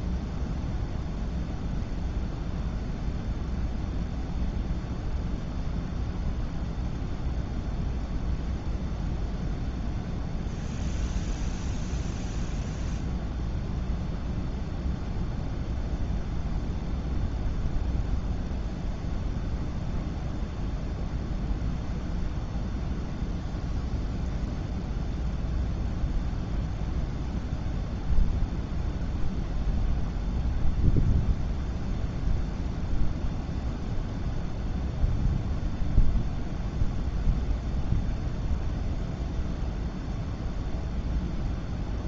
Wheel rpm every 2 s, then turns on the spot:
0, 0, 0, 0, 0, 0, 0, 0, 0, 0, 0, 0, 0, 0, 0, 0, 0, 0, 0, 0, 0.
none